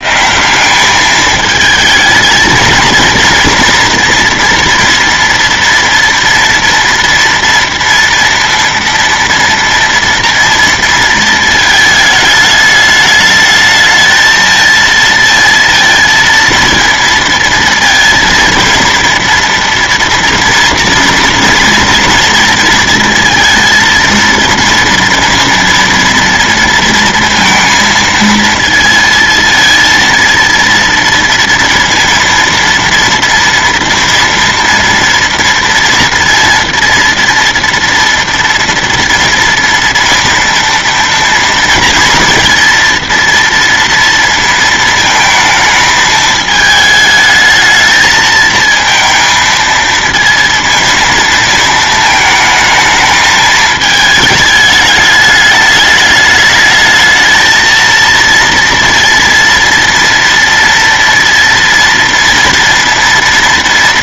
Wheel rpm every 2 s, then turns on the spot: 190, 220, 230, 230, 230, 230, 210, 220, 230, 230, 230, 230, 230, 230, 230, 230, 230, 230, 230, 230, 230, 230, 230, 220, 230, 230, 220, 210, 220, 230, 230, 230.
none